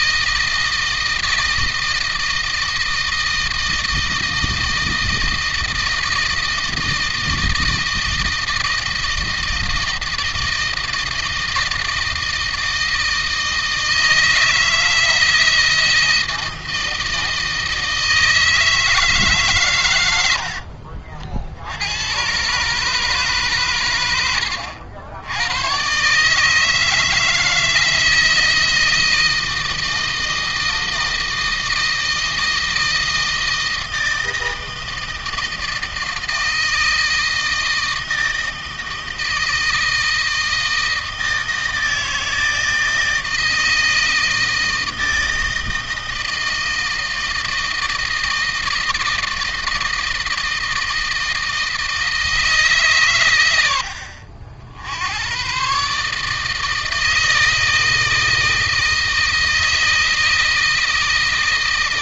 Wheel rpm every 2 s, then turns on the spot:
160, 160, 160, 160, 160, 160, 160, 160, 160, 160, 60, 140, 90, 160, 160, 160, 160, 160, 160, 160, 160, 160, 160, 160, 160, 160, 130, 80, 160, 160, 160.
none